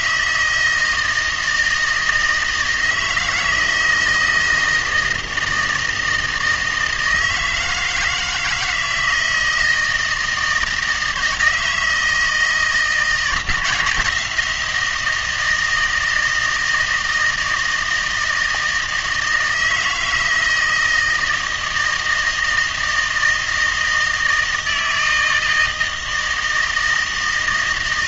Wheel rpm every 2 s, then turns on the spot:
160, 160, 160, 160, 160, 160, 160, 170, 160, 160, 160, 160, 160, 160.
none